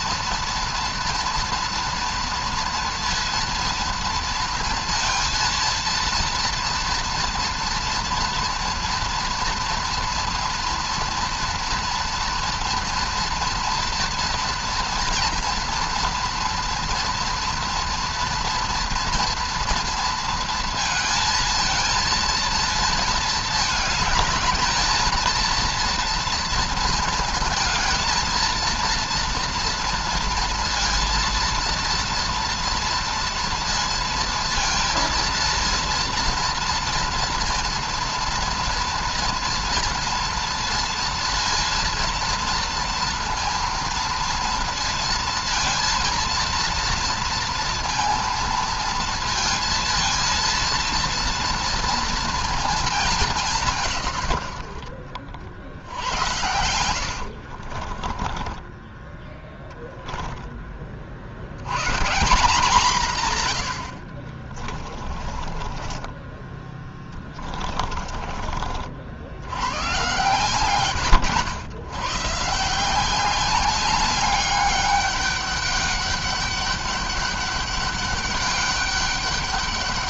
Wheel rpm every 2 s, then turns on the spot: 230, 230, 230, 230, 230, 230, 240, 230, 230, 230, 230, 220, 220, 230, 230, 230, 230, 230, 230, 230, 230, 230, 230, 230, 230, 230, 220, 80, 90, 20, 20, 170, 40, 20, 50, 130, 160, 200, 200, 200.
56-60 64-68